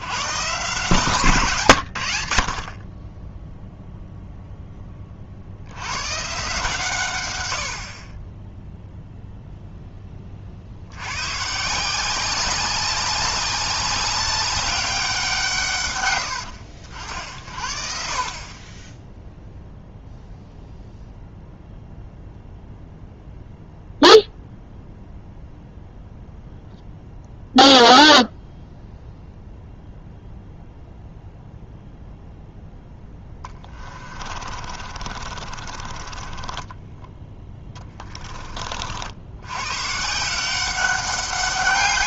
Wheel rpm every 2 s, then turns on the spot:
140, 40, 20, 140, 0, 70, 190, 190, 80, 20, 0, 0, 0, 0, 0, 0, 10, 30, 10, 50, 190.
32-38